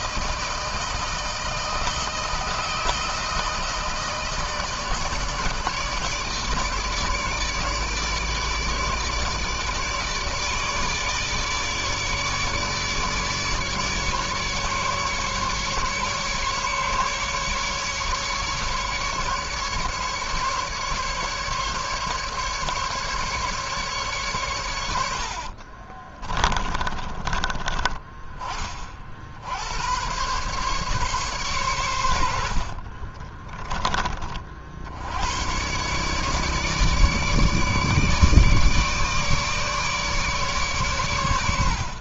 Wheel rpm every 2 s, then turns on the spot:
160, 160, 160, 160, 150, 150, 150, 140, 140, 150, 140, 150, 110, 20, 30, 130, 70, 60, 150, 150, 140.
26-28 32-34